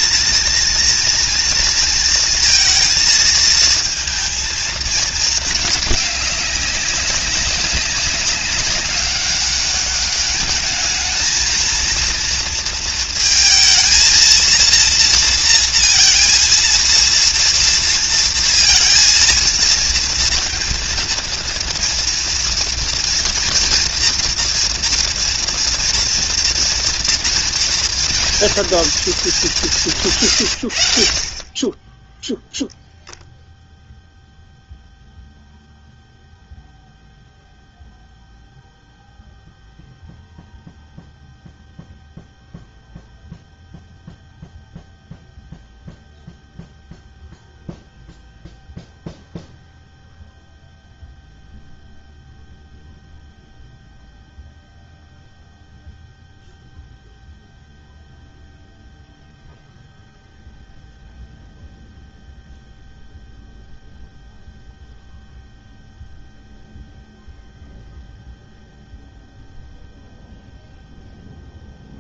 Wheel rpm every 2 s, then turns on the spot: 230, 230, 200, 200, 200, 230, 230, 230, 230, 230, 230, 230, 230, 230, 160, 10, 0, 0, 0, 0, 0, 0, 0, 0, 0, 0, 0, 0, 0, 0, 0, 0, 0, 0, 0, 0.
none